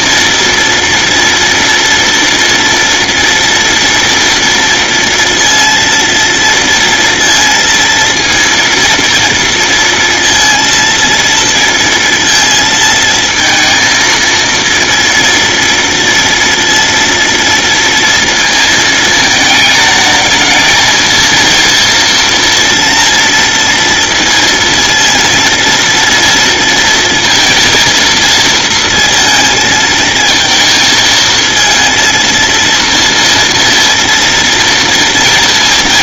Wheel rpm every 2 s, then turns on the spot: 230, 230, 230, 230, 230, 230, 230, 230, 230, 230, 220, 230, 230, 230, 230, 220, 230, 230.
none